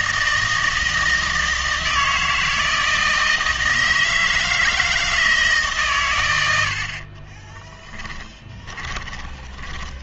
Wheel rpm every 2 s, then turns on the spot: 160, 170, 160, 70, 20.
8-10